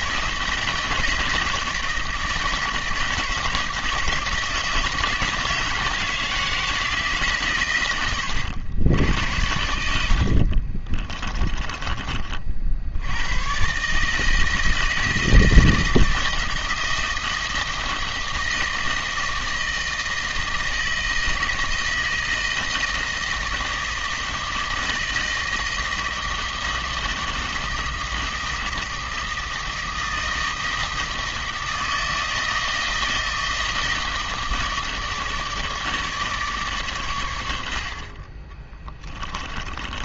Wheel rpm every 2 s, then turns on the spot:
160, 160, 160, 160, 90, 40, 60, 160, 160, 160, 160, 160, 160, 160, 160, 160, 160, 160, 140, 20.
10-12 38-40